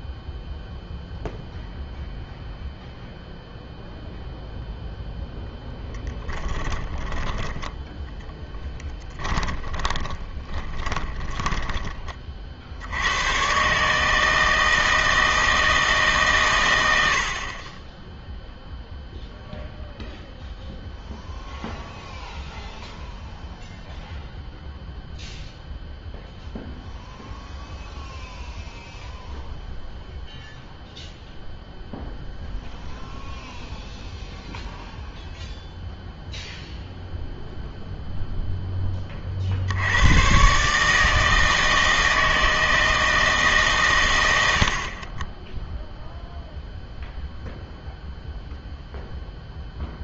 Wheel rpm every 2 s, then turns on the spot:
0, 0, 0, 20, 10, 10, 60, 160, 120, 0, 0, 0, 0, 0, 0, 0, 0, 0, 0, 10, 140, 160, 70, 0, 0.
6-12